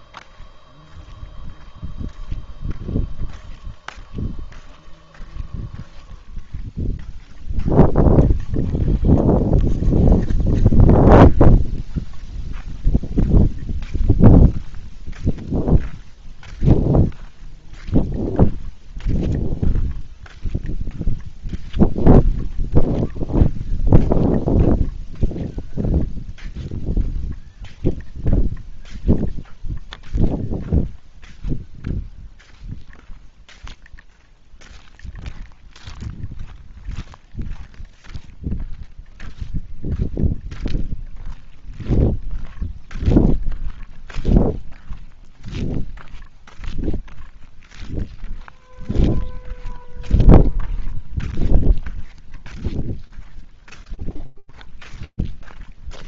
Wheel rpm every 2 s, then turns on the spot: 0, 0, 0, 0, 0, 0, 0, 0, 0, 0, 0, 0, 0, 0, 0, 0, 0, 0, 0, 0, 0, 0, 0, 0, 0, 0, 0, 0.
none